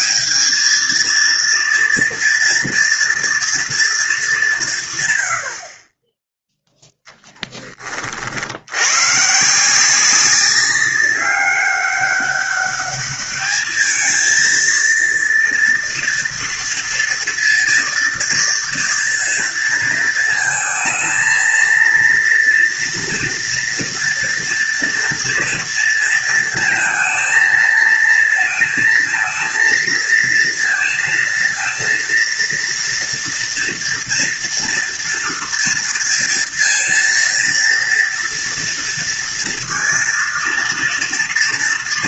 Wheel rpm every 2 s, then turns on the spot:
220, 240, 140, 0, 100, 190, 200, 230, 230, 230, 220, 230, 230, 230, 220, 230, 230, 230, 230, 230, 230.
none